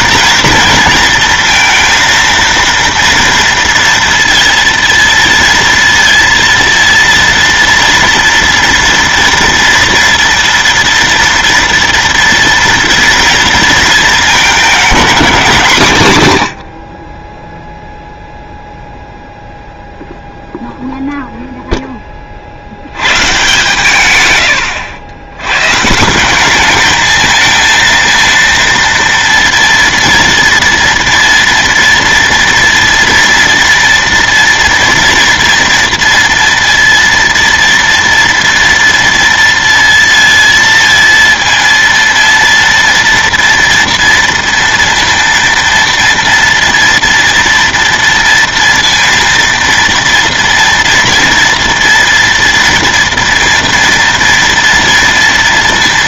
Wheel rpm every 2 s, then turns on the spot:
230, 230, 230, 230, 230, 230, 230, 220, 100, 0, 0, 60, 110, 200, 230, 230, 230, 230, 230, 230, 230, 230, 230, 230, 230, 230, 240, 230.
none